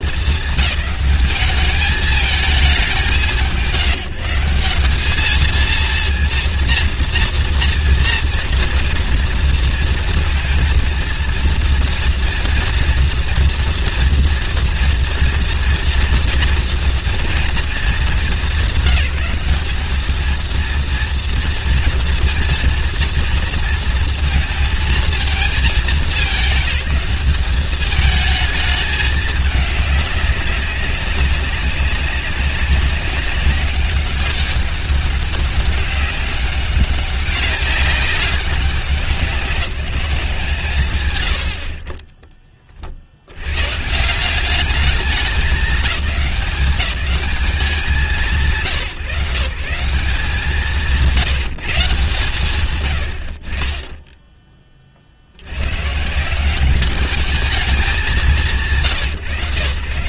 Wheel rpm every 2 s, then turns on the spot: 210, 200, 200, 230, 230, 230, 230, 240, 230, 190, 230, 240, 230, 190, 210, 200, 200, 200, 190, 190, 160, 40, 200, 180, 150, 190, 120, 20, 190, 130.
none